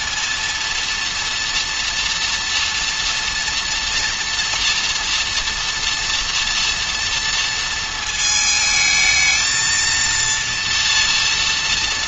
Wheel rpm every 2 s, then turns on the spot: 230, 230, 240, 230, 220, 230.
none